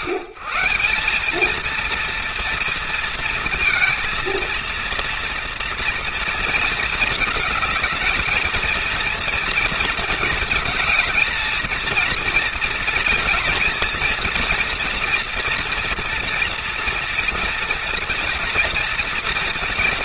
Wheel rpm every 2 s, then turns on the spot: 140, 230, 230, 230, 230, 220, 230, 240, 230, 240.
none